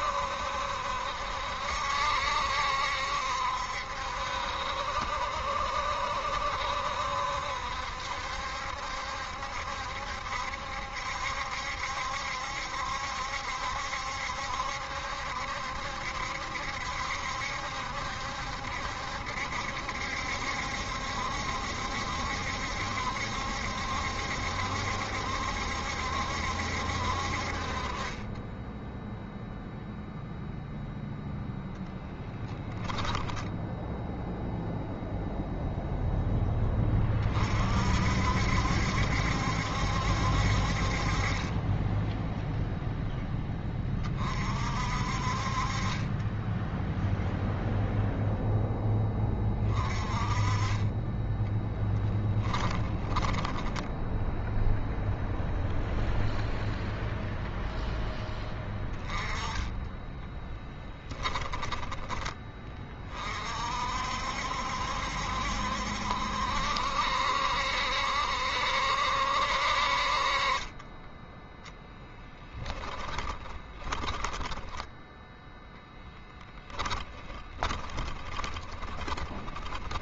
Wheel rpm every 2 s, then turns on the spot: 70, 70, 70, 70, 70, 70, 70, 70, 70, 70, 70, 70, 70, 70, 20, 0, 10, 0, 10, 60, 60, 10, 40, 20, 0, 30, 10, 0, 0, 10, 10, 10, 60, 70, 70, 40, 10, 10, 10, 20.
32-34 52-54 60-62 72-76 78-80